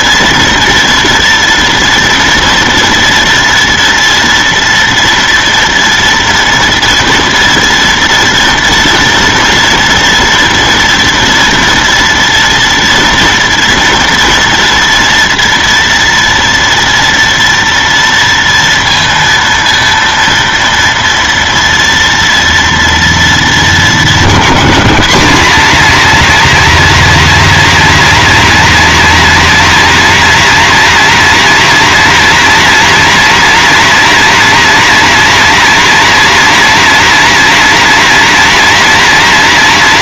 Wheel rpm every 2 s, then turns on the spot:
230, 240, 230, 230, 230, 230, 240, 230, 230, 230, 230, 230, 230, 260, 260, 260, 260, 270, 270, 260.
none